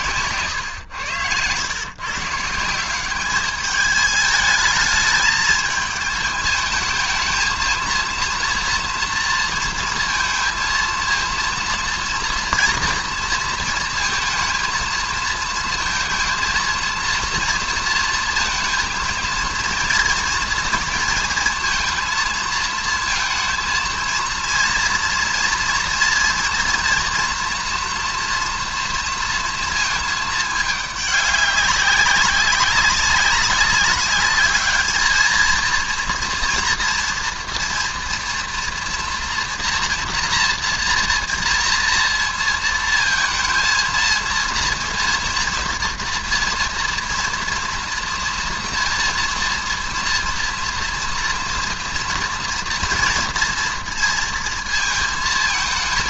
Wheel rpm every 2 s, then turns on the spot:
130, 160, 220, 220, 230, 230, 230, 230, 230, 230, 240, 230, 230, 230, 230, 210, 200, 210, 230, 240, 240, 230, 230, 230, 240, 230, 230, 230.
none